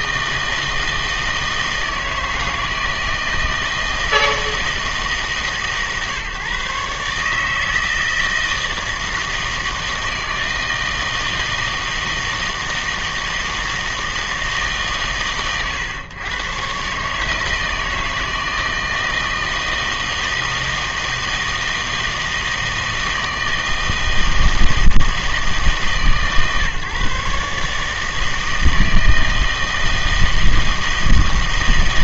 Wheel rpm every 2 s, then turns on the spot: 160, 160, 160, 140, 160, 160, 160, 150, 120, 160, 160, 160, 160, 140, 160, 160.
none